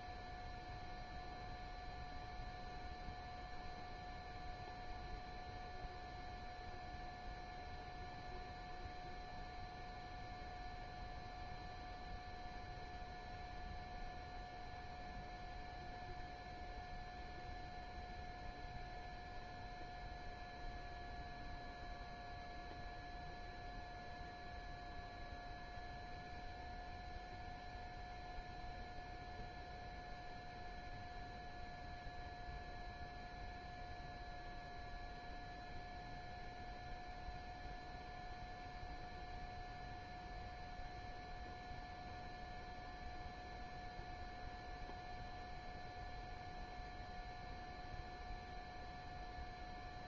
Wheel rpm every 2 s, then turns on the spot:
0, 0, 0, 0, 0, 0, 0, 0, 0, 0, 0, 0, 0, 0, 0, 0, 0, 0, 0, 0, 0, 0, 0, 0, 0.
none